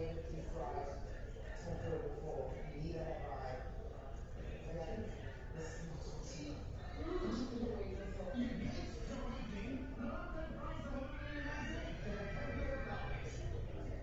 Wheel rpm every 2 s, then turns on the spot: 0, 0, 0, 0, 0, 0, 0.
none